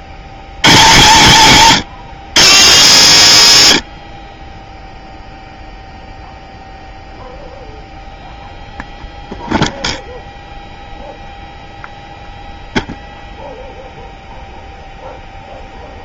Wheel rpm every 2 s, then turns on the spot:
150, 180, 0, 0, 0, 0, 0, 0.
none